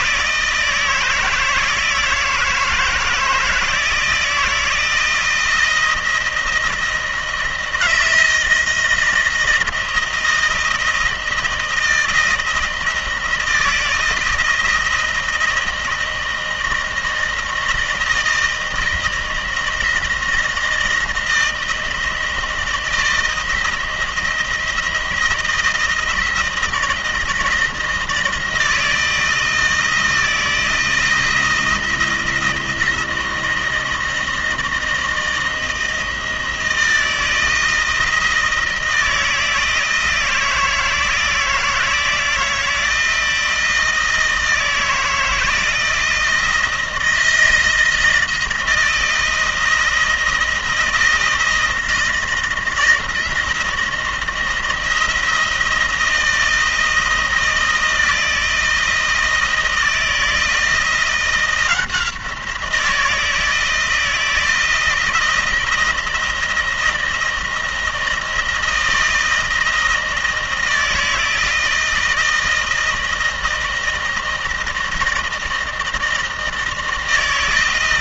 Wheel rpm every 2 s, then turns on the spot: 160, 160, 160, 160, 170, 170, 160, 160, 160, 160, 160, 160, 160, 160, 160, 160, 160, 160, 160, 160, 160, 160, 160, 170, 160, 160, 170, 160, 160, 160, 160, 170, 160, 160, 160, 160, 160, 160, 160.
none